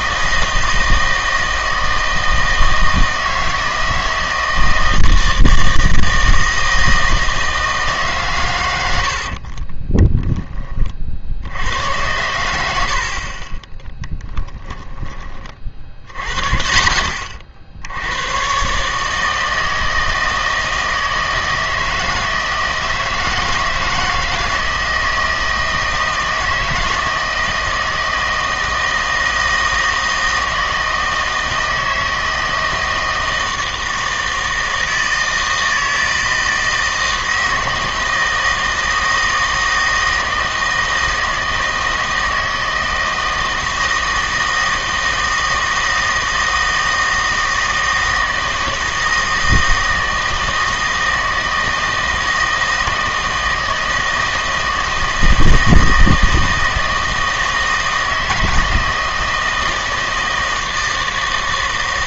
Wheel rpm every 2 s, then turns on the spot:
160, 160, 160, 160, 110, 20, 80, 10, 70, 130, 160, 160, 160, 160, 160, 160, 160, 160, 160, 160, 160, 160, 160, 160, 160, 160, 160, 160, 160, 160, 160.
14-16